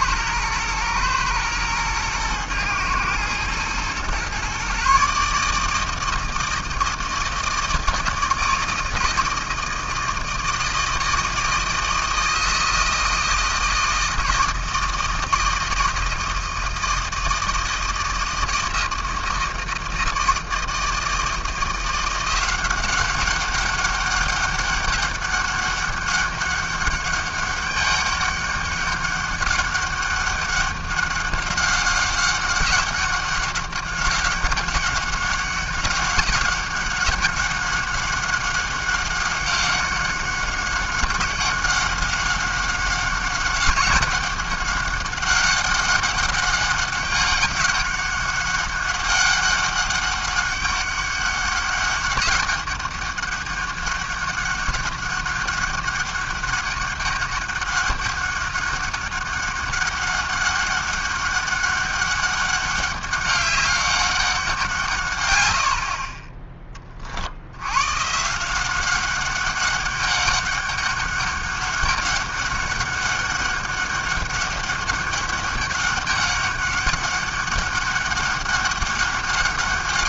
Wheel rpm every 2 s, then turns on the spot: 110, 110, 130, 160, 160, 160, 160, 160, 160, 160, 160, 180, 200, 200, 200, 200, 190, 190, 200, 190, 200, 190, 200, 200, 200, 200, 200, 200, 200, 200, 200, 200, 180, 20, 180, 200, 200, 200, 200, 200.
none